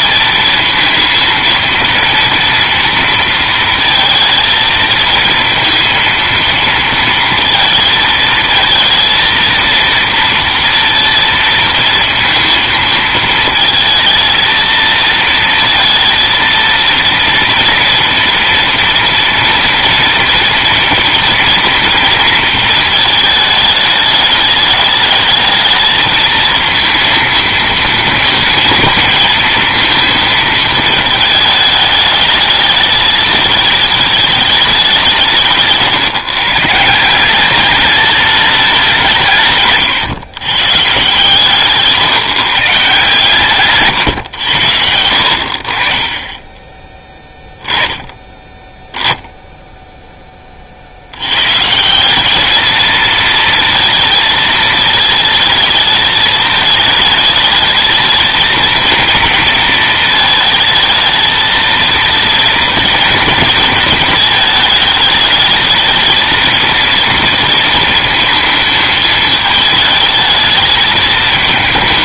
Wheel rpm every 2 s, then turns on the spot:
220, 230, 230, 230, 220, 230, 230, 220, 230, 230, 230, 230, 210, 230, 220, 220, 210, 200, 150, 200, 130, 160, 100, 10, 10, 40, 210, 220, 220, 220, 220, 220, 210, 220, 220, 220.
none